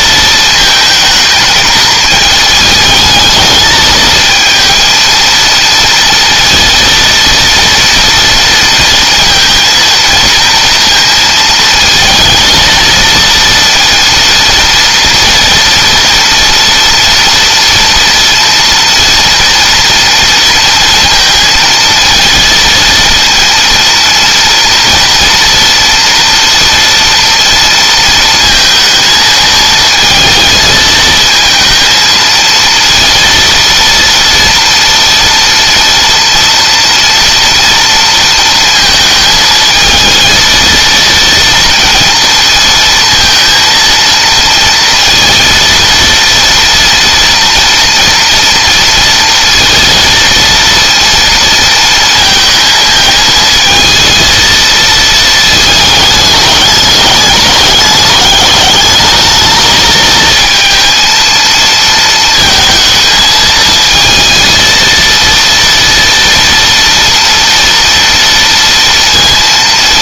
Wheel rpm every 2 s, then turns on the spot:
220, 220, 230, 230, 230, 230, 220, 230, 230, 230, 230, 230, 230, 230, 230, 220, 230, 230, 230, 220, 230, 230, 230, 230, 230, 230, 220, 220, 210, 210, 230, 220, 230, 230, 230.
none